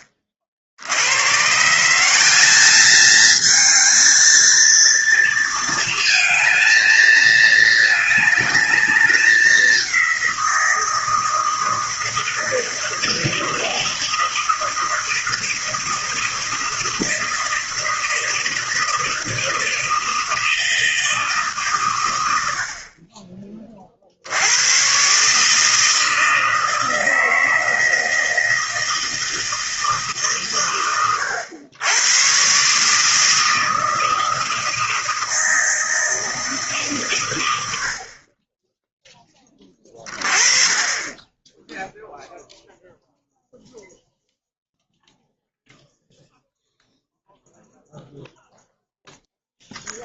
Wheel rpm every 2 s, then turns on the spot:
60, 210, 230, 220, 210, 170, 160, 160, 160, 160, 160, 70, 100, 160, 160, 120, 140, 160, 150, 10, 30, 0, 0, 0, 0.
none